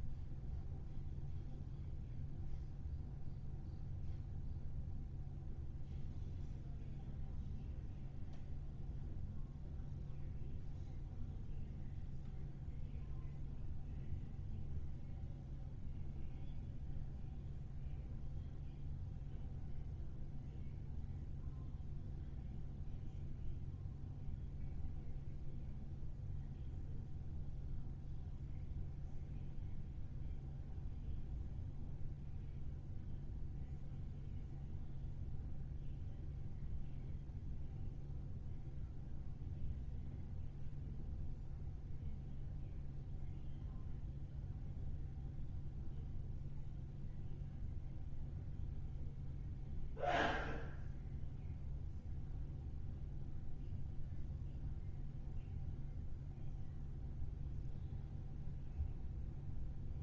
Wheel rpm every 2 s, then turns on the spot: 0, 0, 0, 0, 0, 0, 0, 0, 0, 0, 0, 0, 0, 0, 0, 0, 0, 0, 0, 0, 0, 0, 0, 0, 0, 0, 0, 0, 0, 0.
none